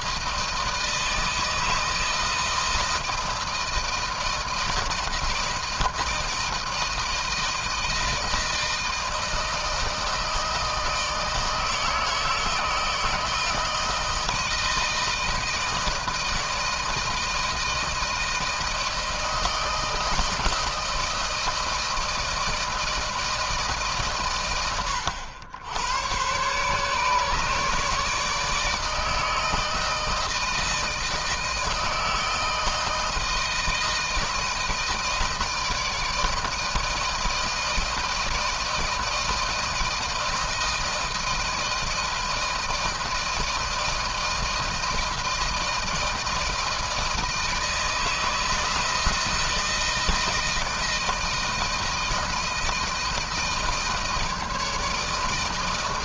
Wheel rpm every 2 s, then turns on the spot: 160, 160, 160, 160, 160, 160, 160, 160, 160, 160, 160, 160, 130, 120, 150, 160, 160, 160, 160, 160, 160, 160, 160, 160, 160, 170, 160, 160.
none